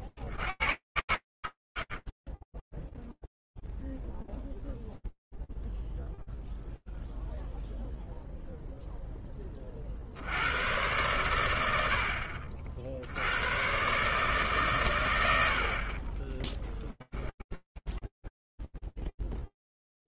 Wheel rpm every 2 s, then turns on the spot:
60, 10, 0, 0, 0, 80, 60, 140, 20, 0.
none